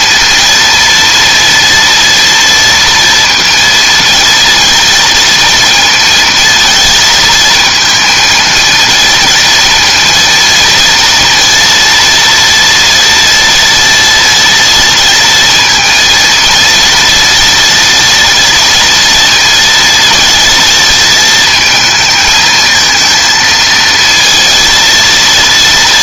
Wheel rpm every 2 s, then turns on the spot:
230, 230, 230, 230, 230, 230, 230, 230, 230, 230, 230, 220, 230.
none